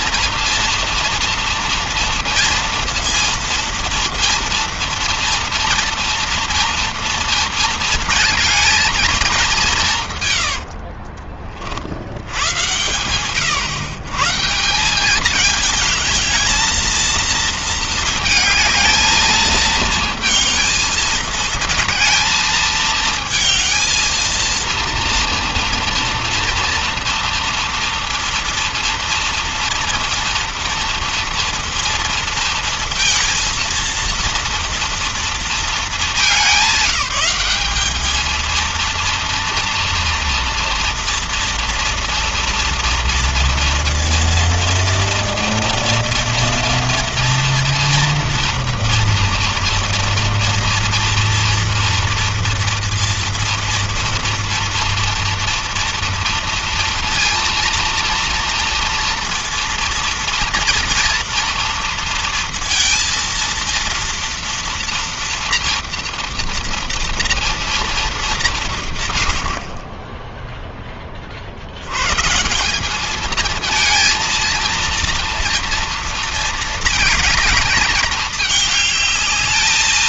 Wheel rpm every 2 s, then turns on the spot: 240, 230, 230, 230, 220, 80, 90, 150, 220, 220, 220, 220, 230, 230, 230, 230, 230, 230, 190, 220, 230, 230, 240, 230, 240, 230, 230, 230, 230, 230, 230, 230, 230, 230, 190, 20, 170, 230, 230, 210.
10-12